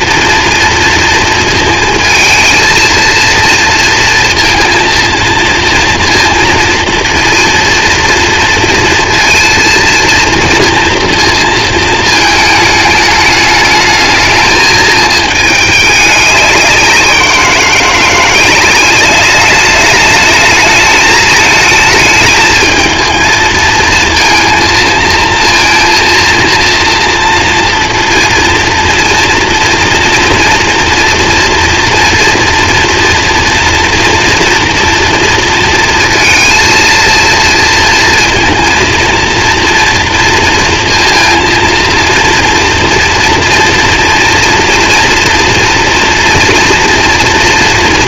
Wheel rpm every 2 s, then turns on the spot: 230, 230, 230, 230, 230, 230, 210, 220, 180, 200, 220, 220, 230, 230, 240, 230, 230, 230, 230, 230, 230, 230, 240, 230.
none